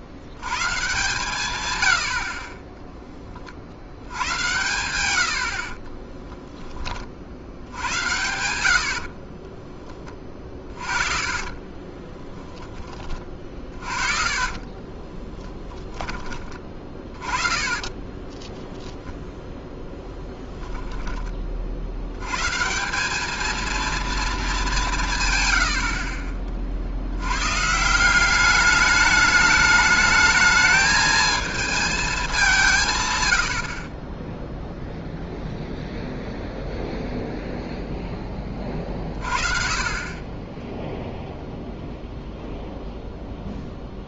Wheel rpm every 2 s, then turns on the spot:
110, 30, 100, 10, 80, 30, 20, 30, 20, 10, 10, 130, 200, 50, 200, 220, 170, 0, 0, 20, 20, 0.
10-18